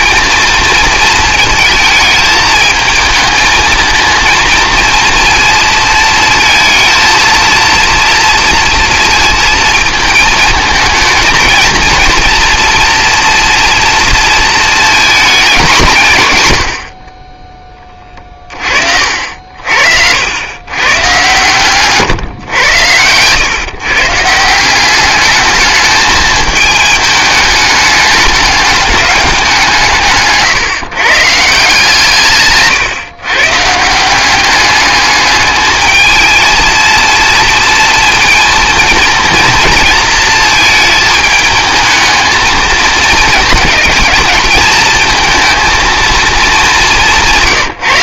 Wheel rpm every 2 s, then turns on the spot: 220, 220, 230, 220, 230, 220, 230, 220, 120, 40, 120, 110, 170, 220, 210, 160, 140, 200, 220, 230, 220, 220, 220, 210.
32-34